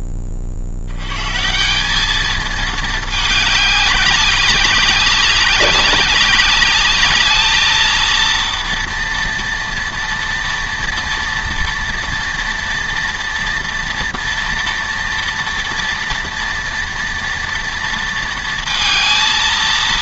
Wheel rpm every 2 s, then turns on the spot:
0, 170, 200, 200, 220, 230, 230, 230, 230, 230.
none